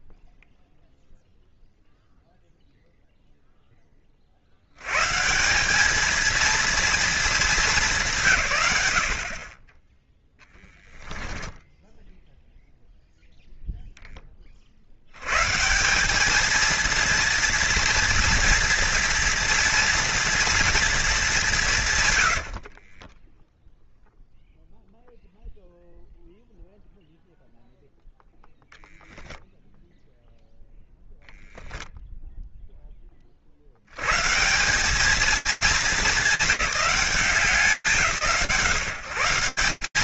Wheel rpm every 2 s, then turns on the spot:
0, 0, 110, 230, 40, 10, 0, 130, 230, 230, 200, 10, 0, 0, 0, 0, 70, 210, 170, 160.
10-12 22-24